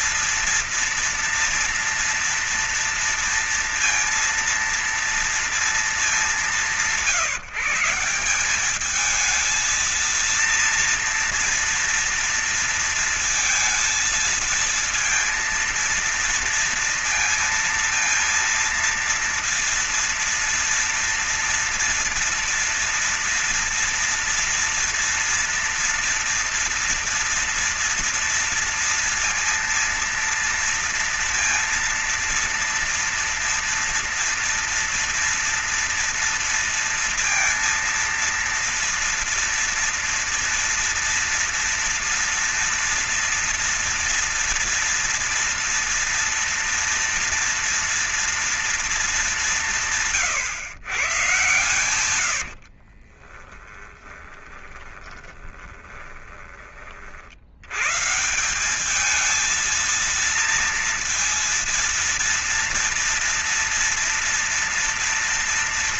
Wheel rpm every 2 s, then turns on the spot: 230, 230, 230, 190, 190, 230, 230, 230, 230, 230, 230, 230, 230, 230, 230, 230, 230, 230, 230, 230, 230, 230, 230, 230, 230, 130, 70, 10, 20, 180, 230, 230, 230.
52-56